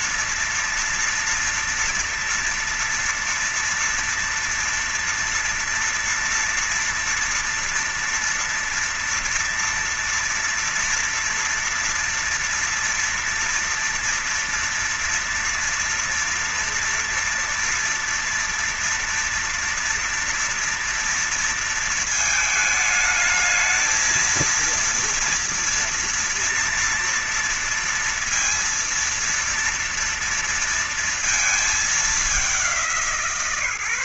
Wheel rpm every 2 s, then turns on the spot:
230, 230, 230, 240, 230, 230, 240, 230, 230, 240, 230, 220, 220, 230, 230, 230, 200.
none